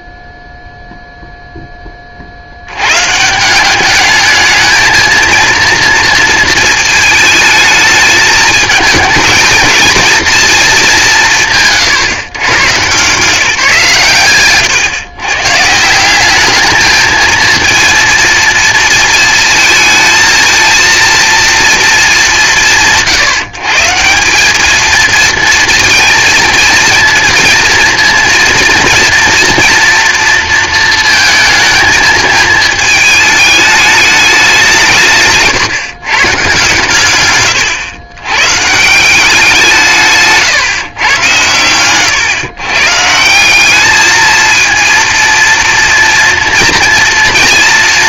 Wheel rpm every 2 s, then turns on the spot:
0, 90, 220, 220, 220, 230, 120, 130, 220, 230, 230, 170, 220, 220, 230, 230, 220, 180, 130, 160, 130, 130, 220, 230.
none